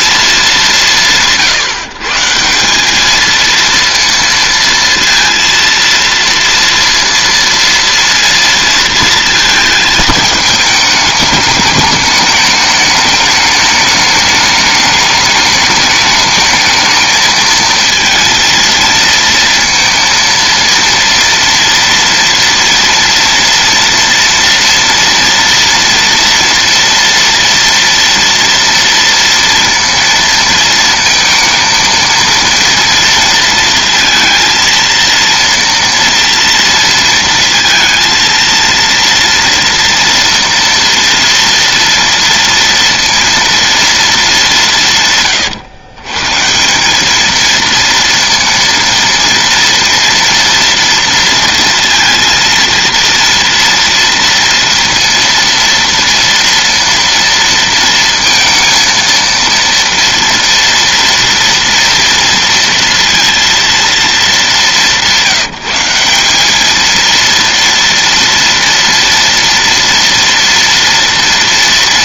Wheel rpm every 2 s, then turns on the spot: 160, 210, 230, 230, 230, 210, 210, 210, 220, 230, 230, 230, 230, 230, 230, 230, 230, 230, 230, 230, 230, 230, 140, 210, 230, 230, 230, 230, 230, 230, 230, 230, 180, 230, 230, 230.
none